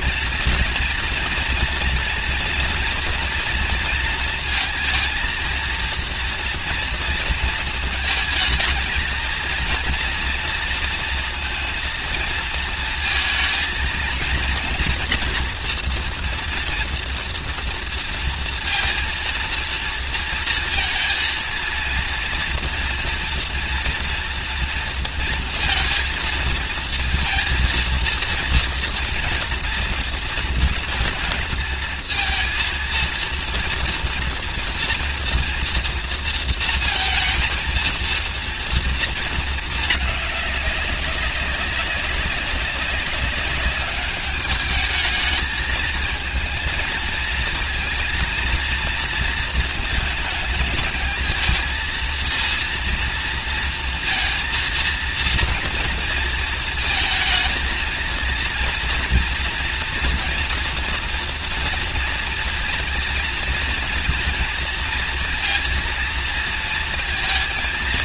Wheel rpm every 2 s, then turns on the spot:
230, 240, 230, 230, 230, 230, 230, 240, 230, 230, 230, 230, 230, 230, 230, 230, 230, 230, 230, 230, 200, 200, 210, 220, 230, 220, 230, 230, 220, 230, 230, 230, 230, 230.
none